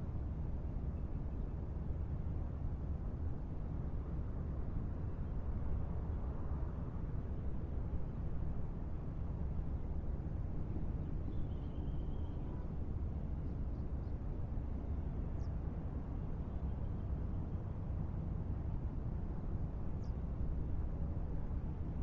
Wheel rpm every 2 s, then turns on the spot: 0, 0, 0, 0, 0, 0, 0, 0, 0, 0, 0.
none